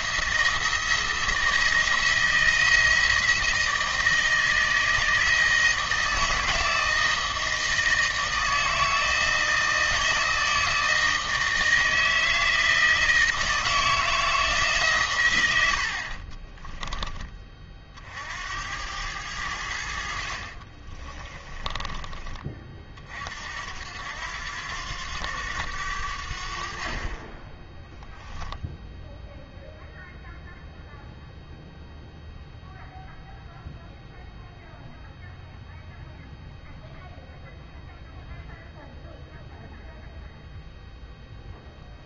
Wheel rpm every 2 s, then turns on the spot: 170, 170, 160, 160, 160, 160, 160, 140, 20, 90, 50, 30, 90, 50, 0, 0, 0, 0, 0, 0, 0.
16-18 20-22